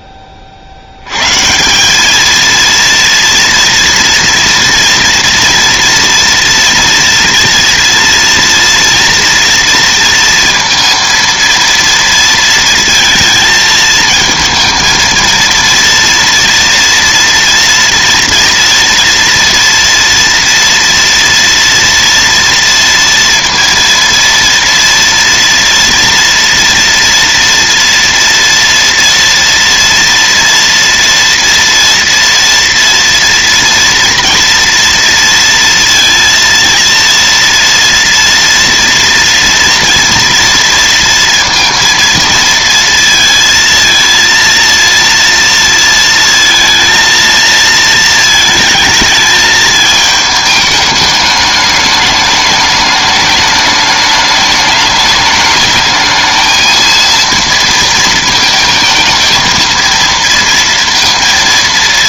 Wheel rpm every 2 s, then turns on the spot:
60, 230, 230, 230, 230, 230, 230, 230, 230, 230, 230, 230, 240, 230, 230, 240, 230, 230, 230, 230, 230, 230, 230, 230, 220, 210, 210, 210, 220, 220, 230.
none